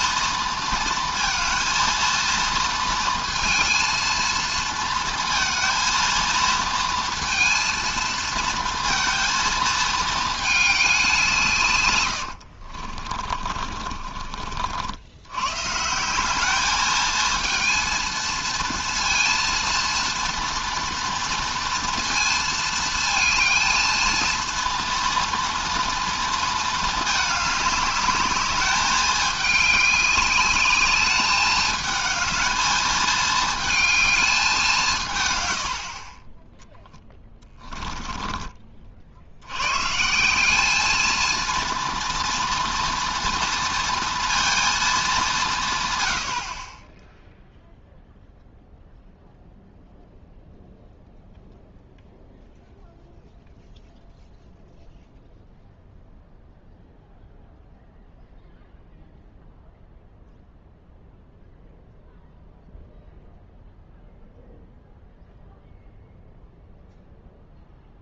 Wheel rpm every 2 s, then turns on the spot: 230, 230, 230, 220, 230, 210, 60, 50, 210, 230, 230, 220, 230, 220, 200, 200, 220, 180, 10, 30, 210, 240, 220, 20, 0, 0, 0, 0, 0, 0, 0, 0, 0, 0.
12-14 36-38